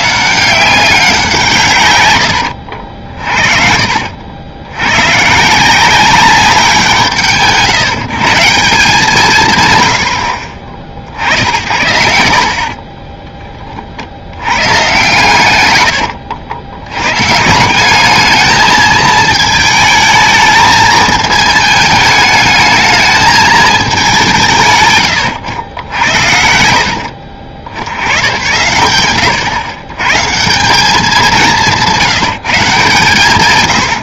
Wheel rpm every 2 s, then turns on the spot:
190, 60, 100, 180, 170, 50, 50, 130, 90, 220, 220, 220, 140, 60, 130, 180, 160.
2-4 12-14